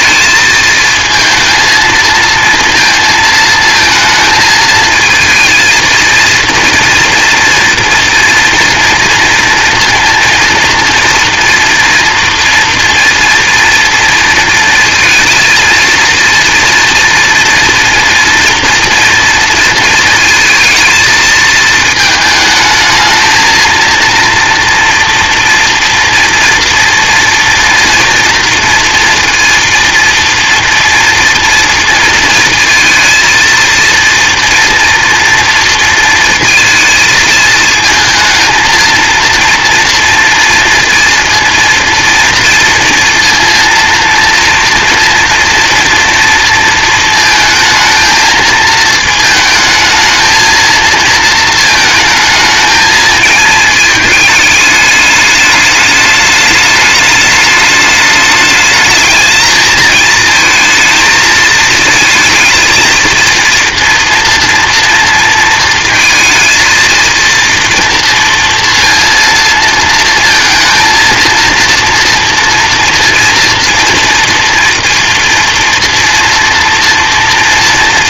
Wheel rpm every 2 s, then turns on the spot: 220, 230, 220, 230, 240, 230, 230, 230, 230, 230, 220, 220, 230, 230, 230, 230, 230, 230, 220, 230, 230, 230, 230, 230, 220, 220, 220, 210, 210, 210, 230, 230, 230, 230, 230, 230, 240, 230, 230.
none